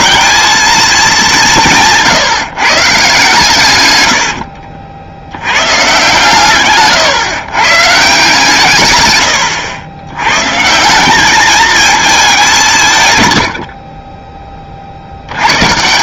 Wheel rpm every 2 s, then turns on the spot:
220, 140, 70, 140, 140, 160, 160, 70.
4-8